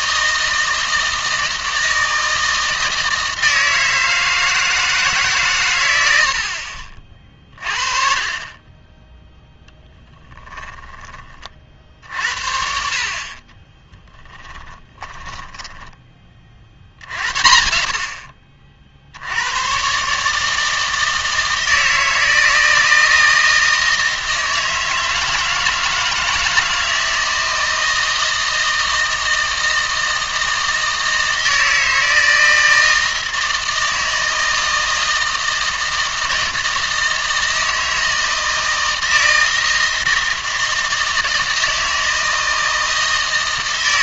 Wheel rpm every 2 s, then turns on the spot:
160, 160, 160, 50, 20, 20, 50, 20, 60, 60, 160, 160, 160, 160, 160, 160, 160, 160, 160, 160, 160, 160.
6-8 10-12 14-16